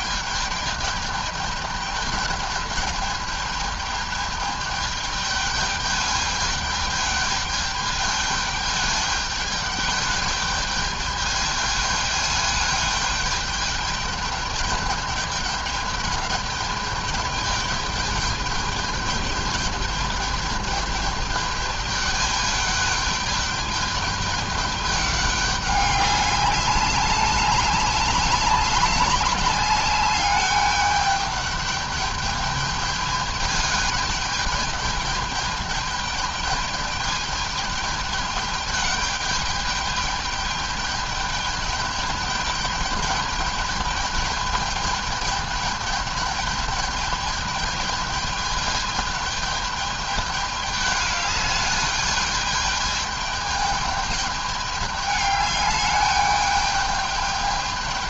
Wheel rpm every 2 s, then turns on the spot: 210, 210, 210, 210, 210, 210, 210, 210, 210, 200, 210, 210, 210, 190, 190, 200, 210, 210, 210, 210, 210, 210, 210, 210, 210, 210, 210, 210, 210.
none